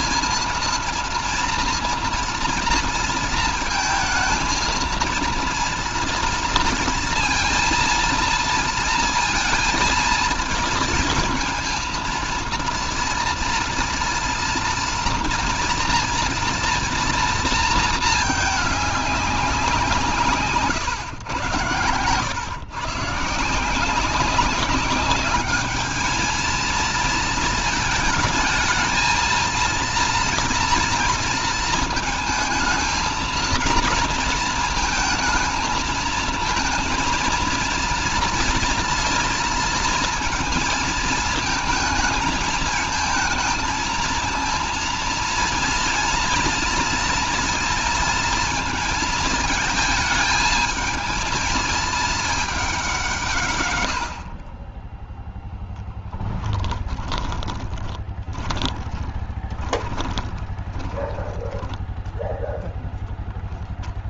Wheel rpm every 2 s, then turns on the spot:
230, 230, 230, 230, 230, 230, 230, 230, 230, 210, 130, 130, 200, 220, 220, 230, 230, 230, 230, 230, 230, 220, 230, 230, 220, 220, 200, 30, 10, 20, 10, 0.
56-62